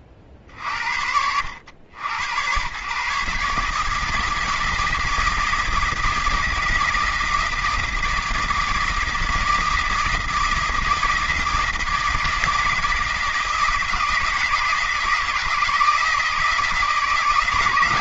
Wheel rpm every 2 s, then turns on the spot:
40, 130, 160, 160, 160, 160, 160, 160, 160.
none